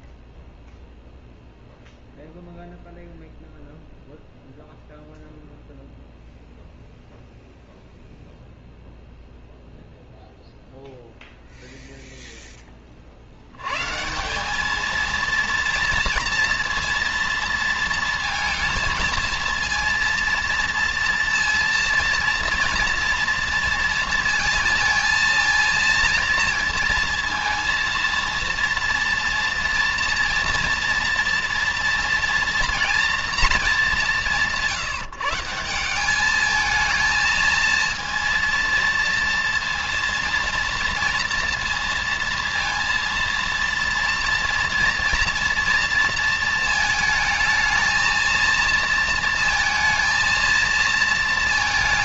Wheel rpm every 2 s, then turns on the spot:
0, 0, 0, 0, 0, 0, 100, 230, 230, 230, 230, 230, 220, 230, 230, 230, 230, 160, 230, 230, 230, 230, 230, 220, 230, 230.
none